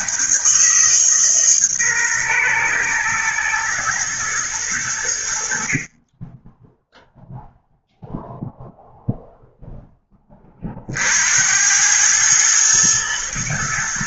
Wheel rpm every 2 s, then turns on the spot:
150, 120, 100, 0, 0, 50, 110.
none